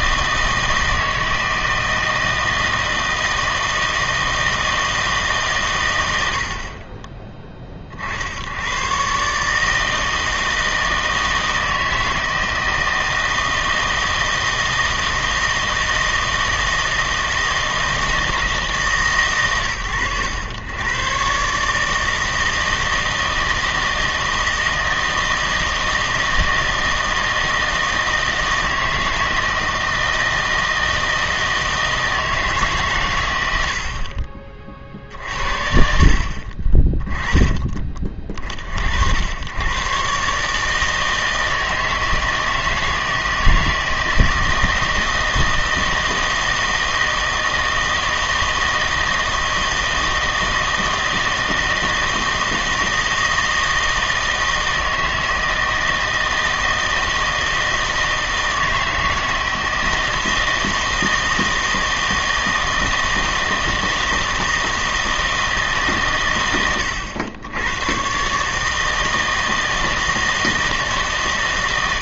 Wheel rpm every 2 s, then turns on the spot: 160, 160, 160, 40, 120, 160, 160, 160, 160, 150, 120, 160, 160, 160, 160, 160, 130, 40, 30, 60, 160, 160, 160, 160, 160, 160, 160, 160, 160, 160, 160, 160, 160, 100, 160, 150.
none